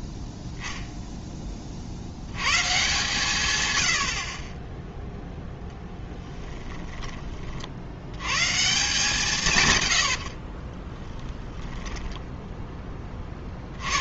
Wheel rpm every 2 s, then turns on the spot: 0, 120, 20, 30, 140, 60, 10.
6-8 10-12